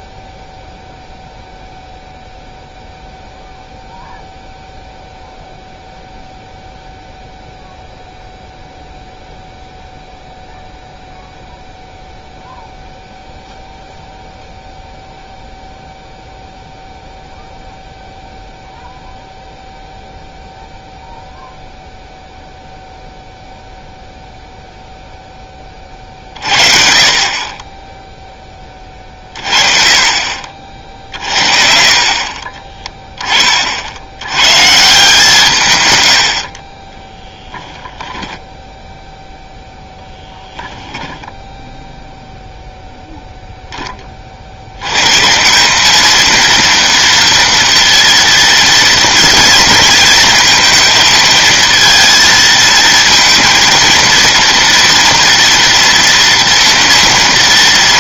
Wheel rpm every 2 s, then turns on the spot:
0, 0, 0, 0, 0, 0, 0, 0, 0, 0, 0, 0, 0, 40, 30, 60, 20, 150, 40, 10, 10, 10, 100, 230, 230, 230, 220, 230, 230.
32-34 38-40